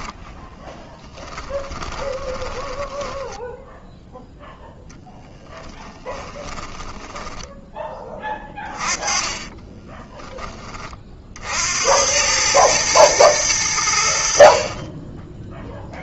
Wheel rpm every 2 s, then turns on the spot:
10, 10, 0, 20, 20, 20, 110, 40.
0-4 6-10 14-16